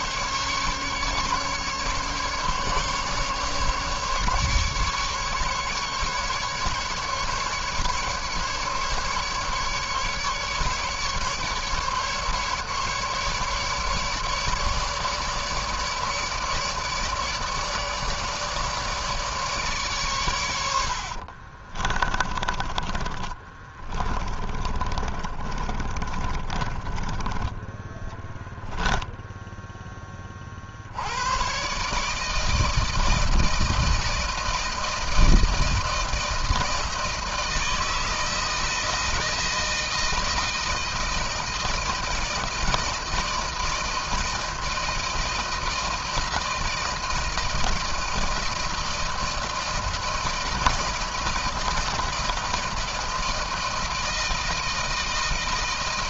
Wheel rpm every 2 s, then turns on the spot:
150, 140, 150, 150, 150, 150, 150, 150, 150, 150, 50, 20, 30, 20, 10, 110, 160, 160, 160, 160, 160, 160, 160, 160, 160, 160, 160, 170.
20-26